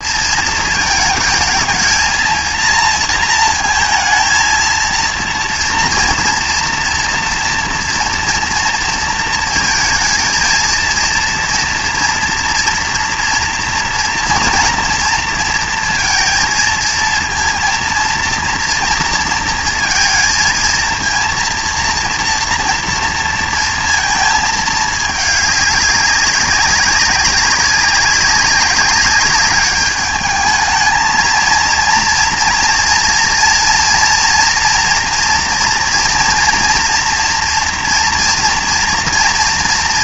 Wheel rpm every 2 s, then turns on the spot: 230, 230, 230, 230, 230, 230, 230, 230, 230, 230, 230, 230, 220, 200, 190, 220, 230, 230, 230, 240.
none